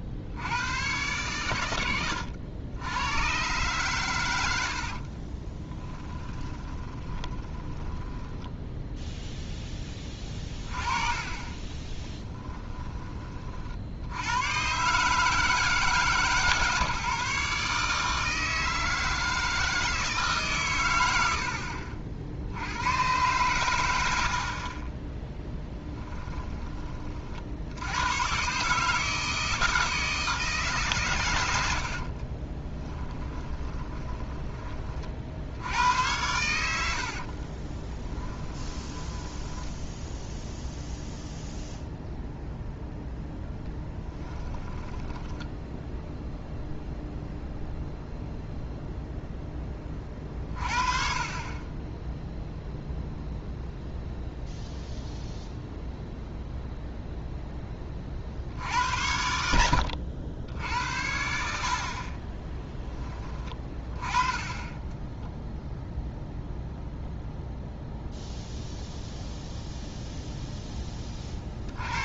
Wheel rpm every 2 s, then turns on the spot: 100, 90, 70, 20, 0, 30, 20, 140, 150, 160, 120, 100, 10, 30, 150, 140, 20, 40, 70, 10, 0, 0, 20, 0, 0, 40, 0, 0, 0, 80, 70, 20, 10, 0, 0, 10.
4-8 32-34 36-40 44-46